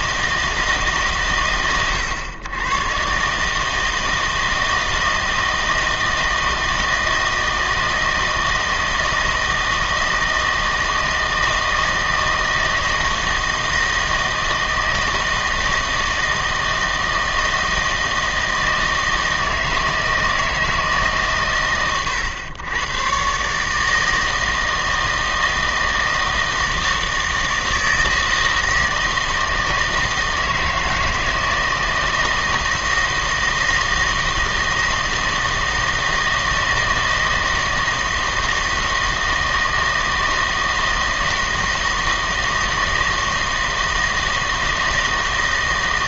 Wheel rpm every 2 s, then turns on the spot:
150, 110, 160, 160, 160, 160, 160, 160, 160, 160, 160, 100, 160, 160, 160, 160, 160, 160, 160, 160, 160, 160, 160.
none